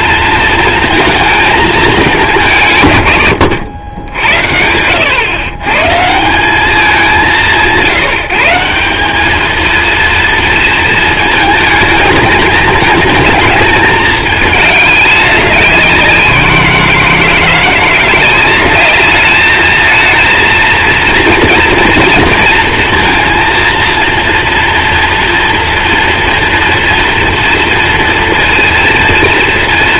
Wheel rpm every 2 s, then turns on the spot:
230, 160, 80, 190, 170, 230, 210, 210, 170, 200, 230, 230, 230, 230, 230.
none